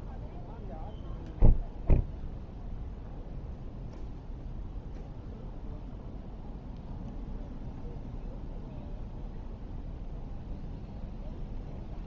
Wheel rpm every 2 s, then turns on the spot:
0, 0, 0, 0, 0, 0.
none